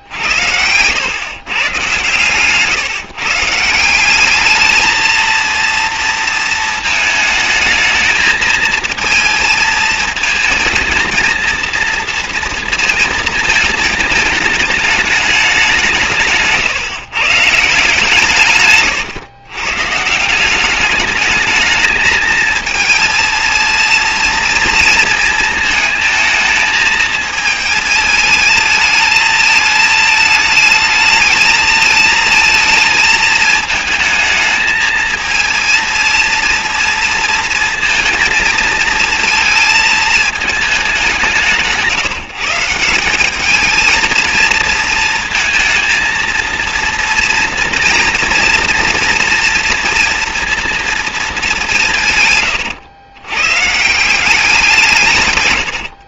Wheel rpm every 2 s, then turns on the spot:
100, 150, 220, 220, 230, 230, 230, 220, 140, 120, 200, 220, 230, 220, 220, 220, 220, 220, 230, 230, 200, 180, 230, 230, 230, 230, 110, 170.
none